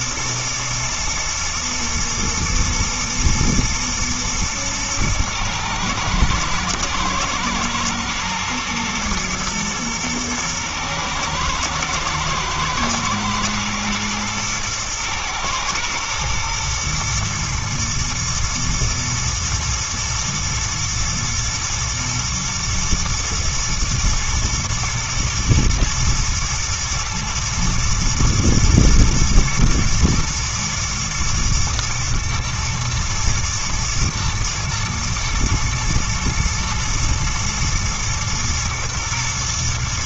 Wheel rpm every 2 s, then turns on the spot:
110, 120, 110, 110, 110, 110, 110, 110, 120, 110, 120, 120, 110, 110, 120, 110, 120, 120, 110, 110.
none